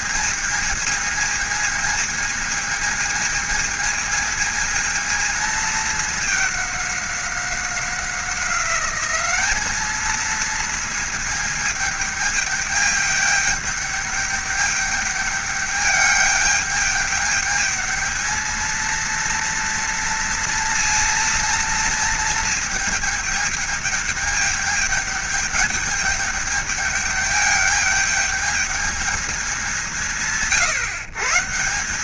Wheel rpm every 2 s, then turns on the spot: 220, 220, 220, 200, 190, 220, 210, 210, 210, 220, 230, 220, 210, 210, 210, 100.
none